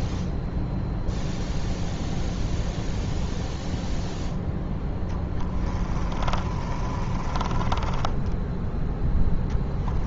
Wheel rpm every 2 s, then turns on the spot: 0, 0, 0, 30, 10.
6-8